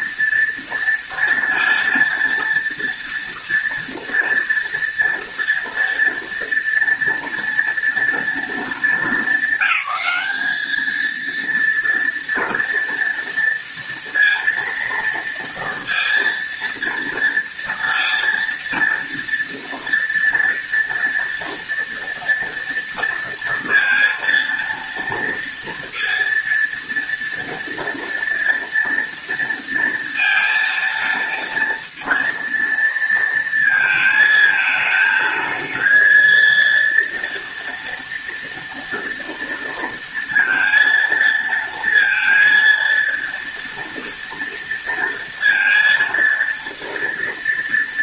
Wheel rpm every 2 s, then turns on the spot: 230, 230, 230, 230, 220, 220, 230, 230, 230, 230, 230, 230, 230, 230, 230, 230, 230, 220, 230, 230, 230, 230, 230, 230.
none